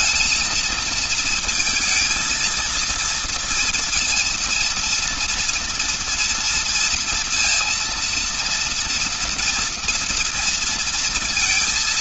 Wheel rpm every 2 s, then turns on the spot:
220, 230, 230, 230, 230, 230.
none